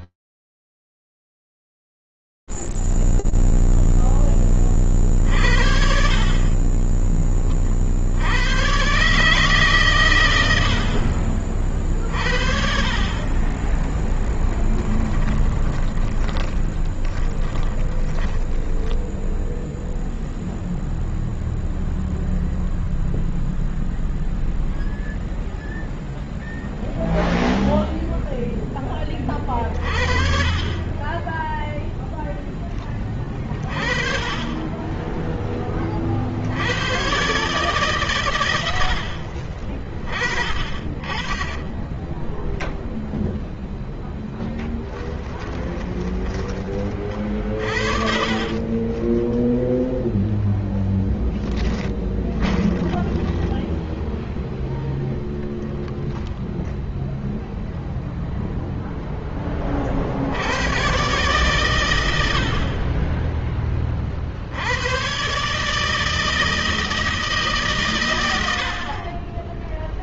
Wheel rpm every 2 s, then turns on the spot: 0, 0, 10, 40, 80, 110, 60, 10, 20, 20, 0, 0, 0, 0, 20, 20, 30, 20, 130, 50, 20, 0, 30, 50, 0, 10, 10, 0, 0, 40, 100, 20, 150, 140, 10.
12-20 44-48 50-52